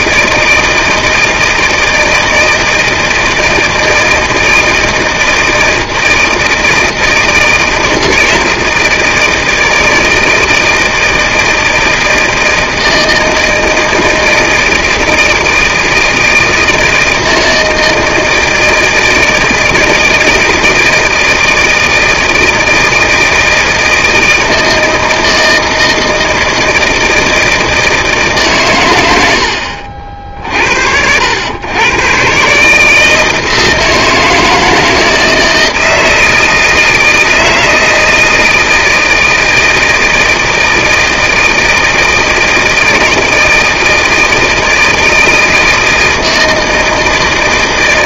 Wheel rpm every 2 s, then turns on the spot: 160, 160, 160, 160, 160, 160, 160, 160, 160, 160, 160, 160, 160, 160, 120, 60, 150, 160, 160, 160, 160, 160, 160, 160.
none